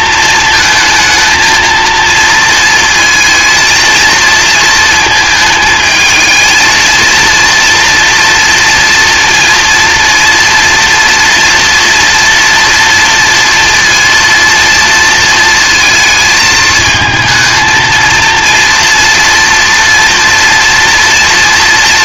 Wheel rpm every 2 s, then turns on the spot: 220, 230, 220, 220, 230, 240, 230, 230, 220, 230, 230.
none